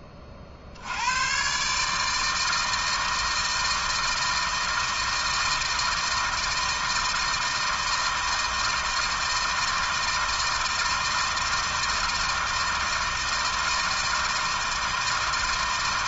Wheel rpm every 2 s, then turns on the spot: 80, 160, 160, 160, 160, 160, 160, 160.
none